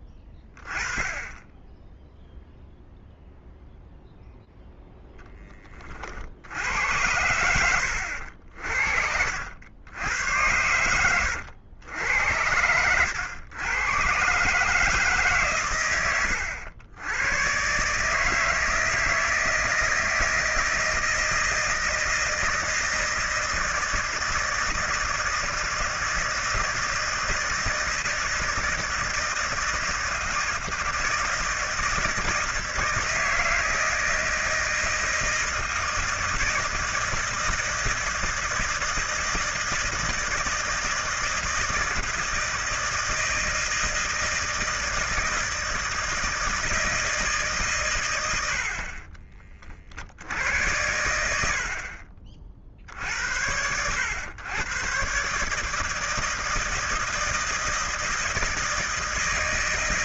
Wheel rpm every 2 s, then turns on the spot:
10, 0, 0, 70, 60, 100, 90, 150, 90, 160, 160, 160, 160, 160, 160, 160, 160, 160, 160, 160, 160, 160, 160, 160, 70, 90, 50, 120, 160, 160.
none